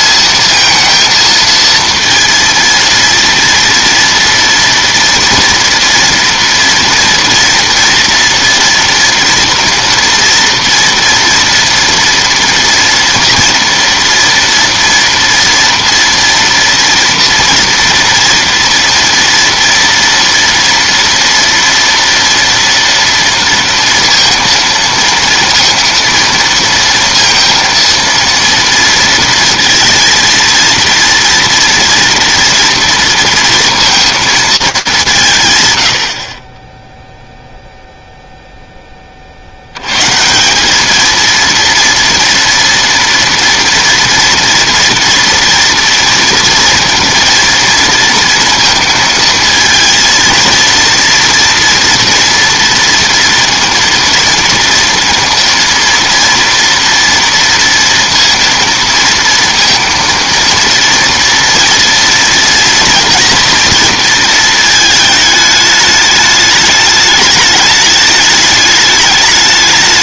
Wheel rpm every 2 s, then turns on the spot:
230, 230, 230, 230, 230, 230, 230, 230, 230, 230, 230, 230, 230, 230, 230, 230, 230, 210, 10, 10, 190, 230, 230, 230, 230, 230, 230, 230, 230, 230, 230, 230, 220, 210, 210.
none